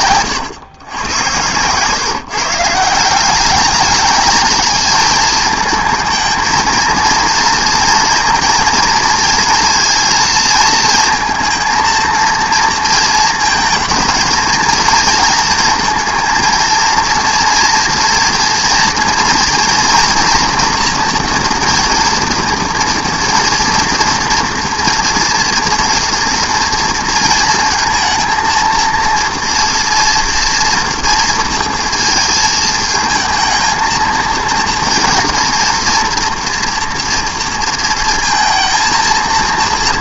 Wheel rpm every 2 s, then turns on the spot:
120, 160, 210, 220, 230, 230, 230, 220, 230, 230, 230, 230, 230, 230, 230, 230, 220, 230, 230, 230.
none